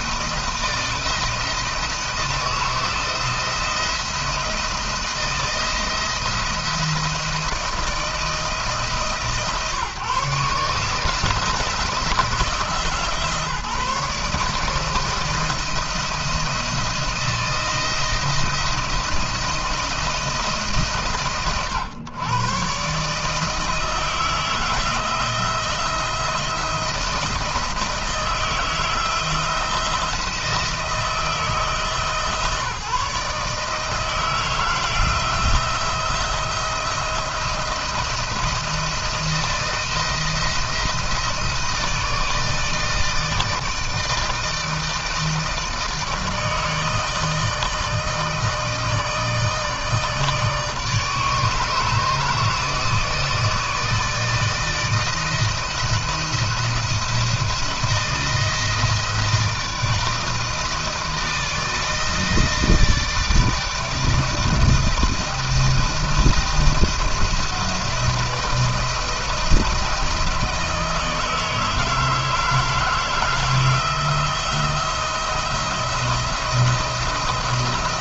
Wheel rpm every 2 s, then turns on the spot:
160, 170, 170, 170, 150, 140, 160, 160, 170, 170, 160, 130, 160, 170, 170, 160, 150, 160, 170, 160, 170, 160, 160, 160, 160, 150, 160, 160, 170, 160, 160, 160, 160, 160, 160, 160, 160, 160, 170.
none